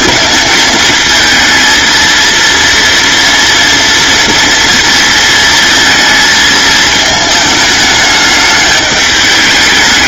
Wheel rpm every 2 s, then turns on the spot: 220, 240, 230, 220, 210.
none